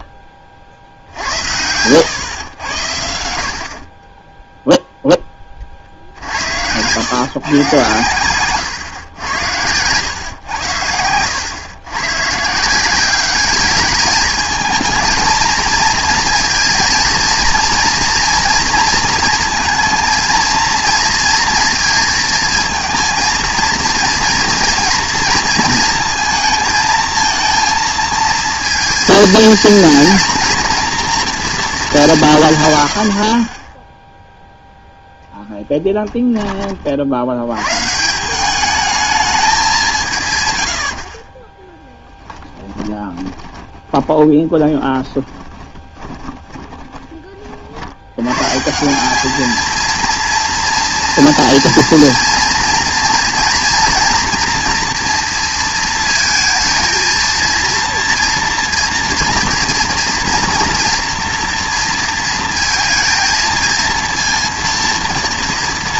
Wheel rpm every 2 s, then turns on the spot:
40, 100, 0, 90, 120, 100, 170, 220, 230, 230, 240, 230, 230, 220, 230, 230, 130, 0, 30, 200, 90, 30, 20, 20, 160, 230, 240, 230, 230, 230, 230, 230, 230.
10-12 42-48